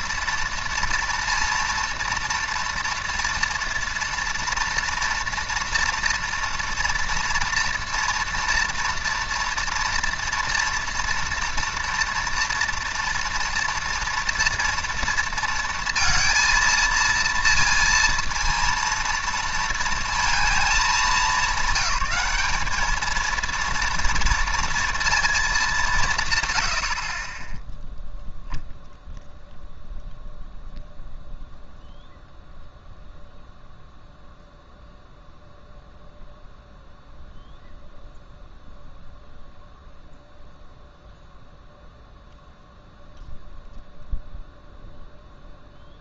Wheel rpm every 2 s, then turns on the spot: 240, 230, 230, 230, 230, 230, 230, 230, 230, 230, 210, 210, 230, 70, 0, 0, 0, 0, 0, 0, 0, 0, 0.
none